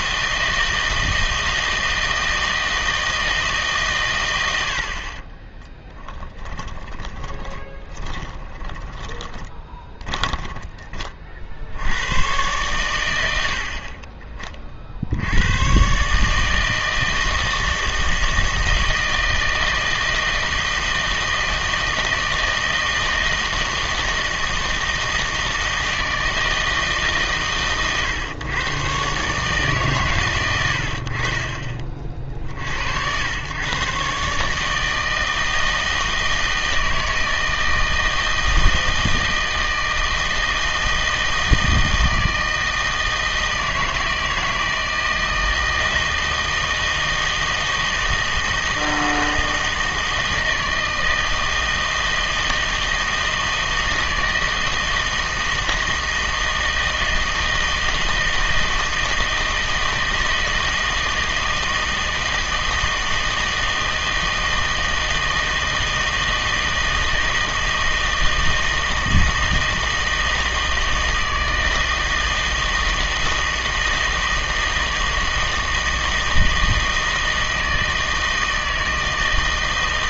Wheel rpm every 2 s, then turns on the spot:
160, 160, 70, 20, 20, 20, 110, 50, 160, 160, 160, 160, 160, 160, 120, 90, 70, 150, 160, 160, 160, 160, 160, 160, 160, 160, 160, 160, 160, 160, 160, 160, 160, 160, 160, 160, 160, 160, 160, 160.
6-10